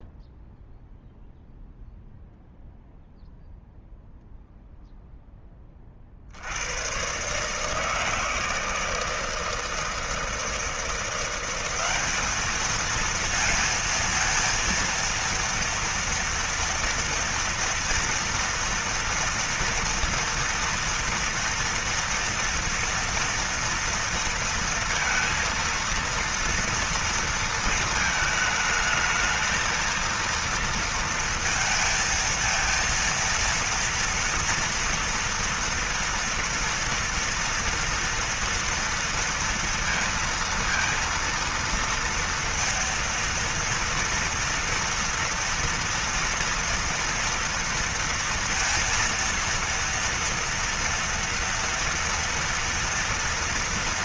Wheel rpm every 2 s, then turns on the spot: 0, 0, 0, 40, 160, 160, 200, 230, 230, 230, 230, 230, 230, 230, 220, 220, 230, 230, 230, 230, 230, 230, 230, 230, 230, 230, 230.
none